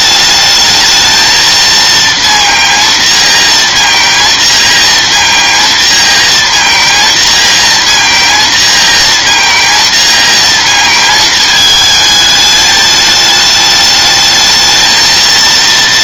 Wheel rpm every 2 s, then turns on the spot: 210, 230, 230, 230, 230, 230, 220, 220.
none